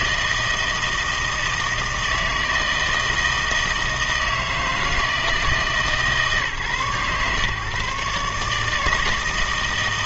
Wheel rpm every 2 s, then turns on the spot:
160, 160, 160, 130, 150.
none